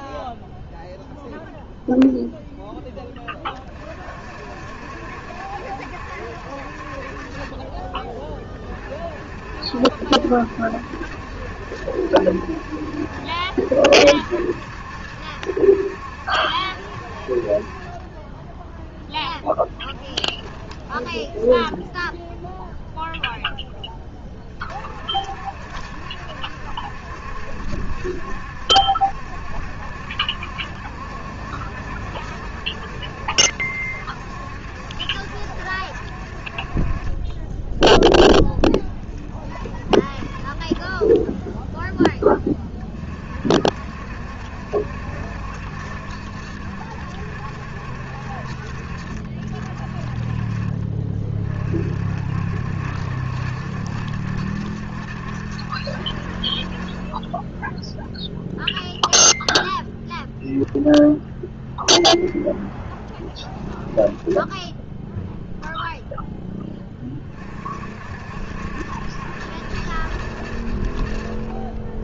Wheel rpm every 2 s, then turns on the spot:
0, 0, 60, 60, 30, 70, 70, 70, 70, 10, 10, 0, 30, 70, 70, 70, 70, 70, 40, 10, 10, 20, 70, 70, 50, 30, 70, 70, 40, 0, 0, 10, 10, 10, 70, 60.
20-22 40-42 62-64